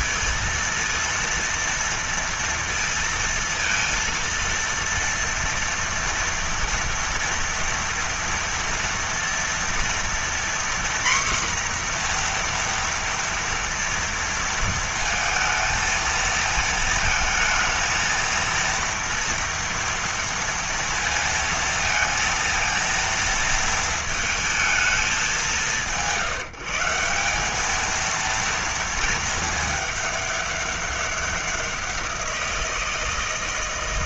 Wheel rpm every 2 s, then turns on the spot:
230, 230, 230, 230, 230, 240, 240, 230, 220, 230, 230, 230, 220, 160, 230, 210, 170.
none